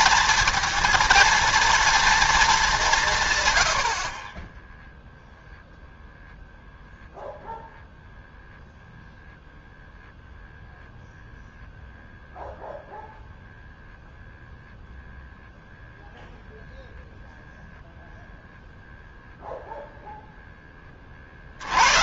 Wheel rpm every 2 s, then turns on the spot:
230, 200, 10, 0, 0, 0, 0, 0, 0, 0, 20.
none